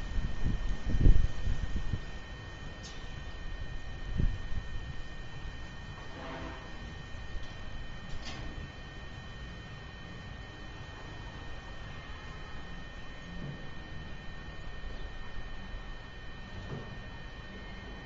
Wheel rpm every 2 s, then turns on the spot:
0, 0, 0, 0, 0, 0, 0, 0, 0.
none